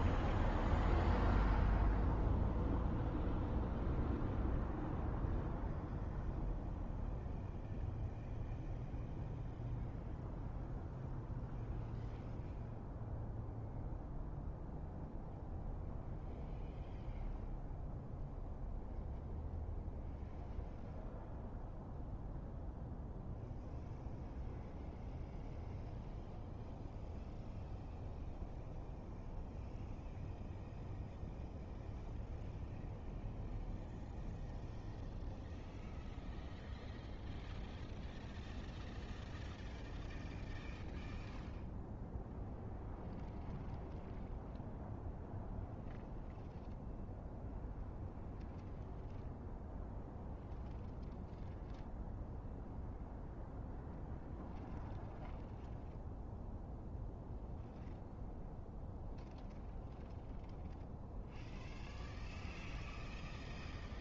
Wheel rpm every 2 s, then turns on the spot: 0, 0, 0, 0, 0, 0, 0, 0, 0, 0, 0, 0, 0, 0, 0, 0, 0, 0, 0, 0, 0, 0, 0, 0, 0, 0, 0, 0, 0, 0, 0, 0.
none